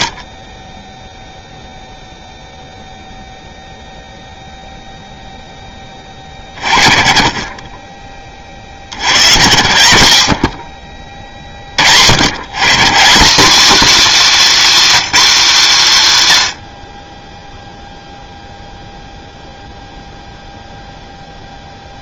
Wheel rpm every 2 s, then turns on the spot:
30, 0, 0, 40, 80, 50, 220, 240, 20, 0, 0.
none